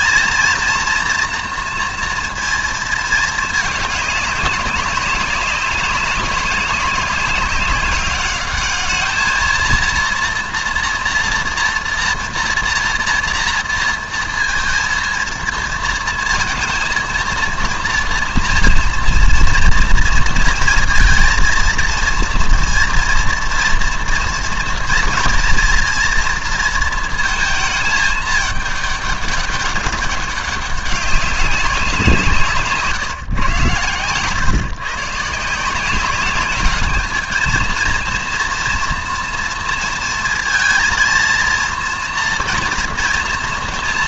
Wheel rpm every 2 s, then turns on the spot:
240, 220, 200, 200, 210, 230, 240, 230, 220, 230, 230, 230, 230, 230, 210, 200, 150, 140, 210, 230, 230, 230.
32-34